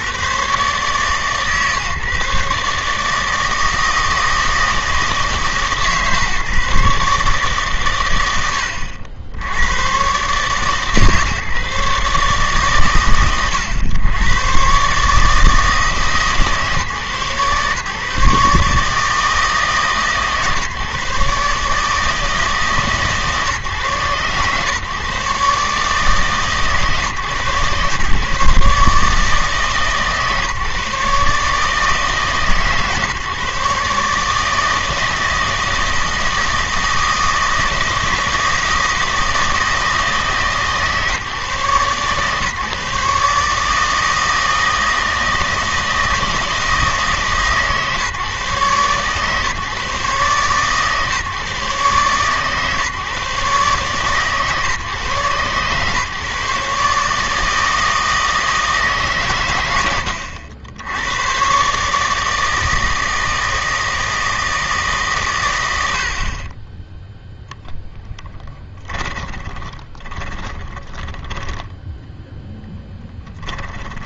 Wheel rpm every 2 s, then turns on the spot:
130, 140, 160, 150, 90, 140, 140, 130, 140, 150, 140, 150, 130, 140, 150, 150, 140, 160, 160, 160, 150, 140, 160, 160, 130, 130, 130, 130, 140, 150, 90, 160, 160, 20, 10, 20, 10.
68-72